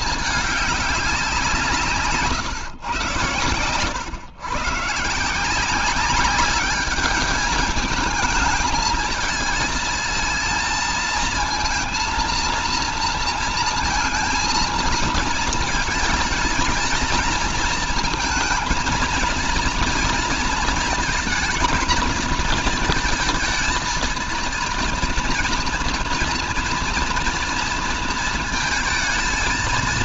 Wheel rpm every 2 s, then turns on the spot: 210, 130, 130, 200, 220, 220, 230, 230, 230, 230, 230, 230, 230, 230, 220.
none